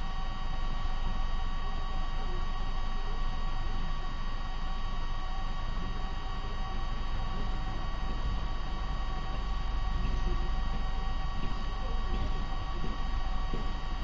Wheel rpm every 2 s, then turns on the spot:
0, 0, 0, 0, 0, 0, 0.
none